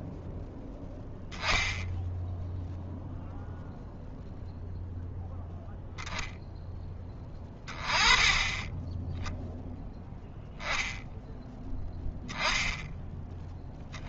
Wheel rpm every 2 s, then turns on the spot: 0, 0, 0, 10, 20, 0, 10.
none